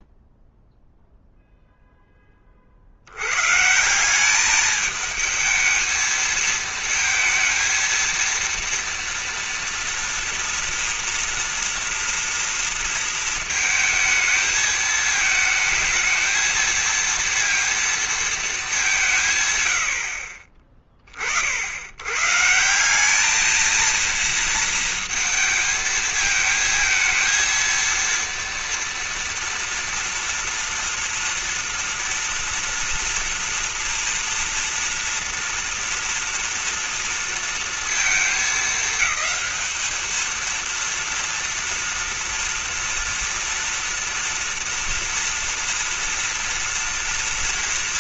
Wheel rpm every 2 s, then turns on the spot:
0, 30, 210, 220, 230, 240, 230, 220, 230, 220, 40, 150, 230, 220, 230, 230, 230, 240, 230, 220, 220, 230, 230, 230.
none